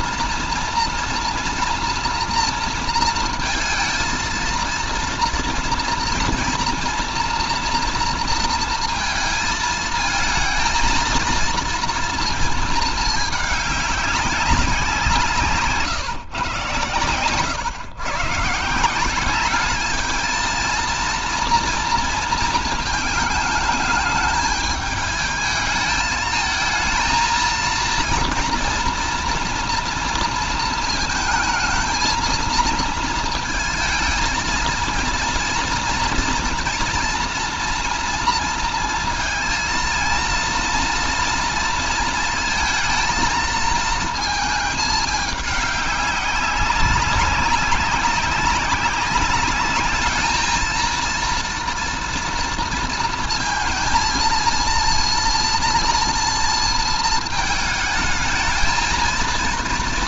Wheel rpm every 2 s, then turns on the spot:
240, 230, 230, 230, 230, 230, 220, 190, 120, 160, 230, 220, 210, 220, 230, 230, 230, 230, 230, 230, 230, 220, 210, 200, 200, 220, 230, 230, 230, 220.
none